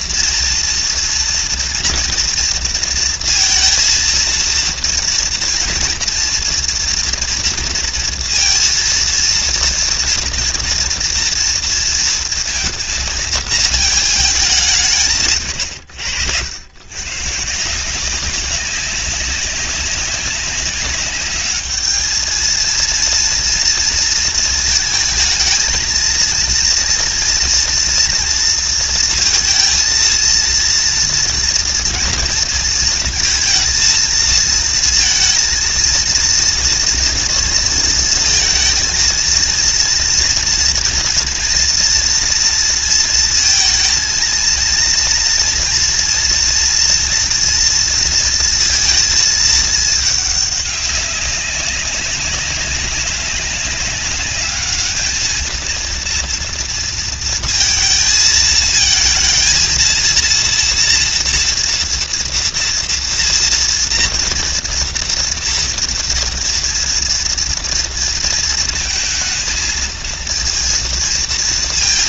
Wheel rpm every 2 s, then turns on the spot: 230, 230, 230, 230, 230, 230, 230, 160, 130, 190, 200, 230, 220, 240, 230, 230, 230, 230, 230, 230, 230, 230, 230, 230, 220, 200, 200, 210, 230, 230, 230, 230, 230, 230, 220, 230.
none